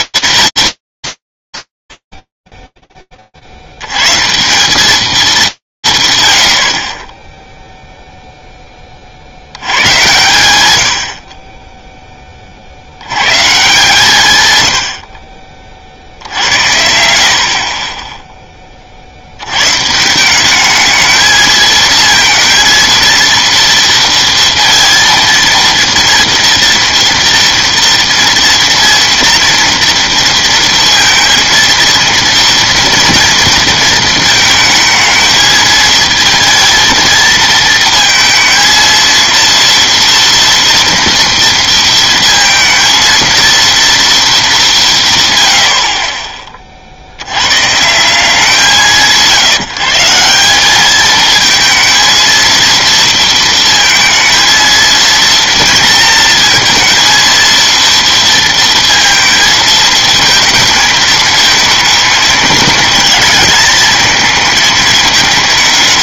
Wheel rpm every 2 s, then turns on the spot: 190, 0, 100, 80, 30, 90, 100, 70, 60, 70, 220, 230, 230, 230, 230, 230, 230, 220, 220, 230, 230, 230, 130, 60, 140, 220, 230, 230, 230, 220, 220, 220, 210.
none